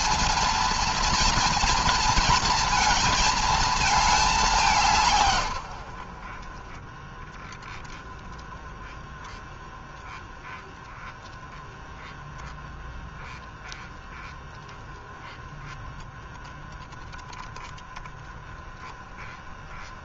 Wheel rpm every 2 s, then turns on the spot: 230, 230, 190, 40, 10, 10, 10, 10, 0, 10.
none